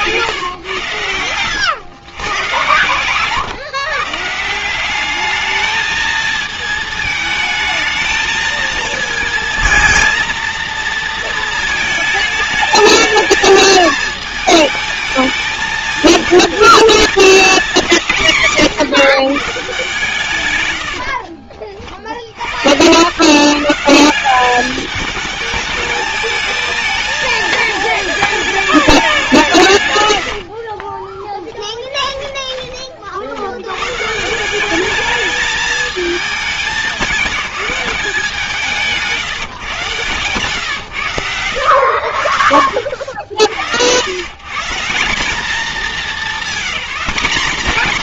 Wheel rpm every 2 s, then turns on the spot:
140, 120, 180, 220, 220, 230, 220, 220, 230, 160, 110, 100, 210, 220, 220, 40, 30, 200, 210, 180, 120, 60, 160, 210.
0-2 30-32